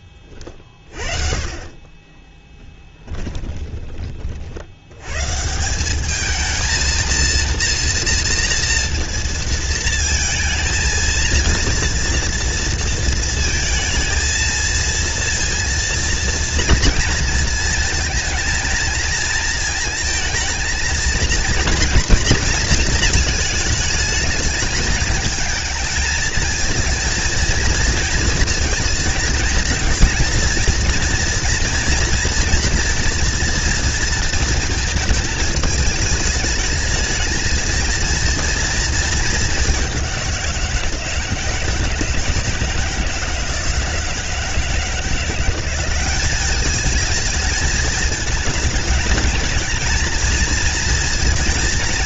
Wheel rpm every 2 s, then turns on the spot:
40, 10, 80, 220, 240, 230, 230, 230, 230, 230, 230, 230, 210, 230, 230, 230, 240, 220, 220, 230, 170, 170, 160, 210, 210, 230.
2-4